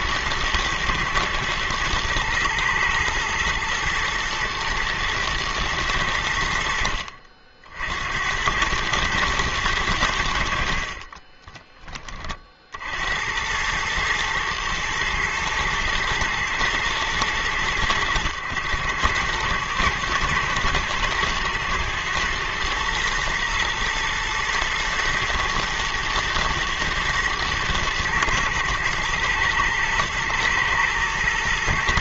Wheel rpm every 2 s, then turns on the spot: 110, 110, 110, 60, 110, 40, 80, 110, 110, 100, 120, 120, 120, 110, 110, 110.
10-12